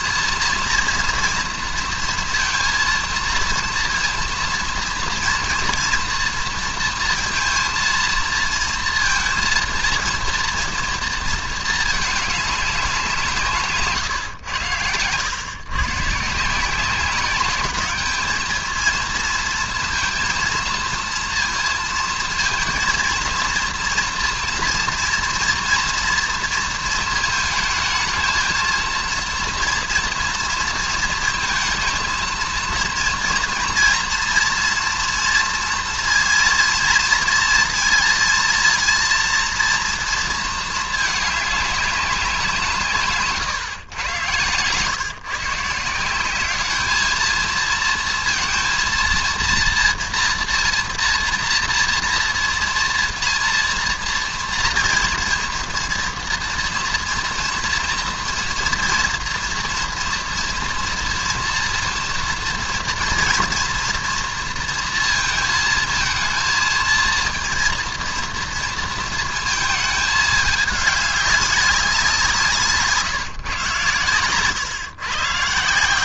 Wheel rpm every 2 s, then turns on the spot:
230, 230, 230, 230, 230, 230, 200, 100, 160, 220, 230, 230, 230, 230, 230, 230, 230, 230, 230, 230, 230, 180, 120, 200, 230, 230, 240, 230, 230, 230, 230, 230, 230, 230, 230, 210, 170, 130.
none